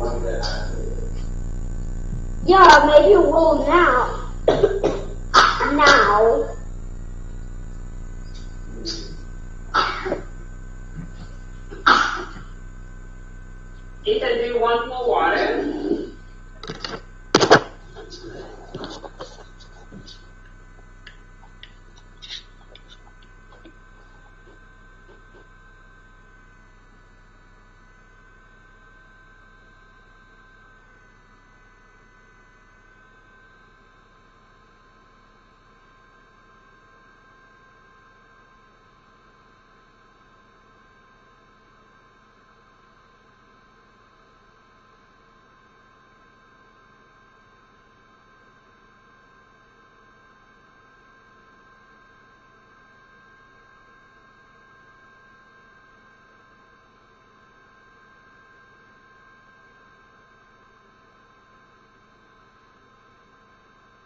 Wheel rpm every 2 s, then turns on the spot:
0, 0, 0, 0, 0, 0, 0, 0, 0, 0, 0, 0, 0, 0, 0, 0, 0, 0, 0, 0, 0, 0, 0, 0, 0, 0, 0, 0, 0, 0, 0, 0.
none